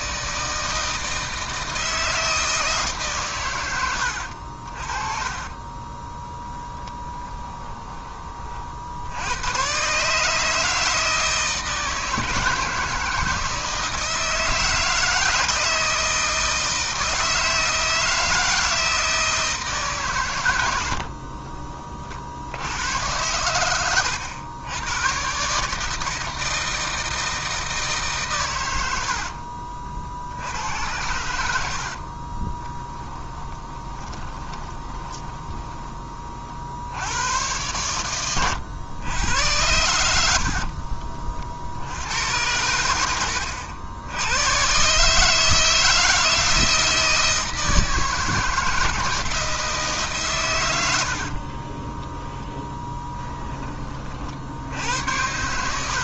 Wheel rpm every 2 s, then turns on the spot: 160, 140, 30, 10, 70, 160, 160, 160, 160, 160, 60, 100, 110, 160, 90, 90, 10, 20, 90, 100, 50, 80, 150, 160, 170, 80, 10, 80.
4-8 20-22 32-36 40-42 52-54